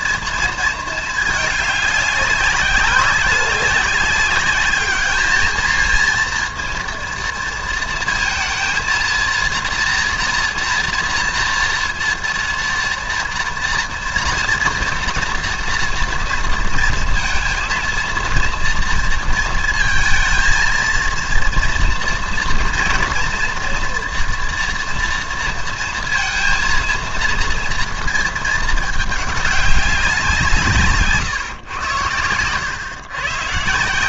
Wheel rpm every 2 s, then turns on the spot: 230, 190, 200, 230, 220, 230, 230, 230, 230, 230, 230, 240, 230, 230, 220, 170, 100.
none